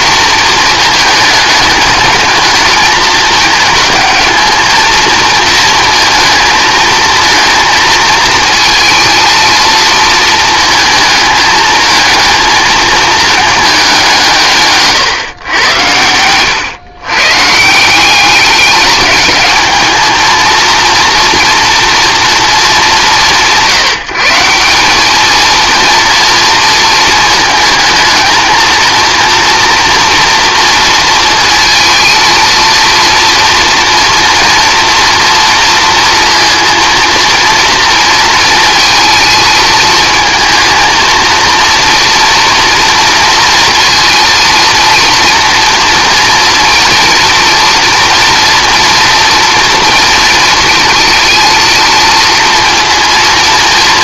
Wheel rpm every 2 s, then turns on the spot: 220, 220, 220, 220, 230, 220, 220, 140, 120, 210, 230, 210, 180, 230, 230, 230, 230, 230, 230, 230, 230, 230, 230, 230, 230, 220, 230.
none